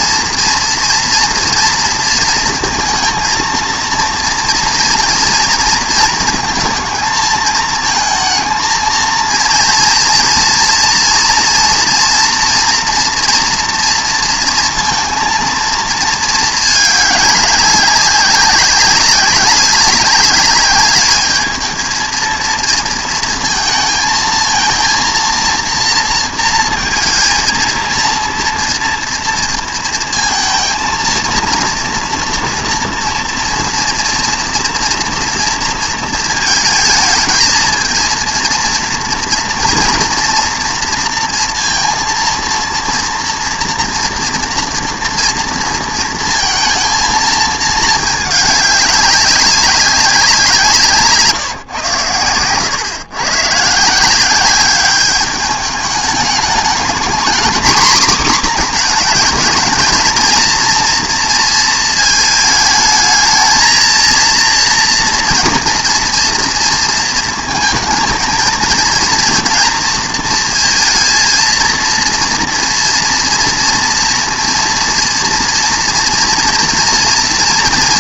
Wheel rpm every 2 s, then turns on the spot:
230, 230, 240, 230, 230, 230, 230, 230, 210, 190, 210, 230, 230, 230, 230, 230, 240, 230, 220, 230, 240, 230, 230, 230, 200, 160, 120, 200, 220, 240, 230, 220, 240, 230, 230, 230, 240, 230, 230.
none